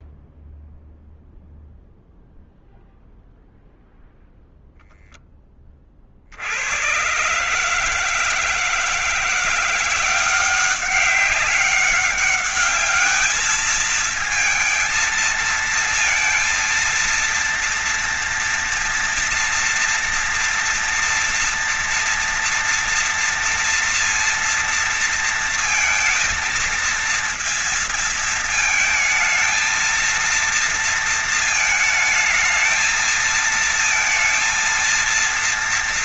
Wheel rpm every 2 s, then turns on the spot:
0, 0, 0, 60, 160, 180, 200, 220, 230, 230, 230, 230, 230, 230, 230, 230, 220, 230.
none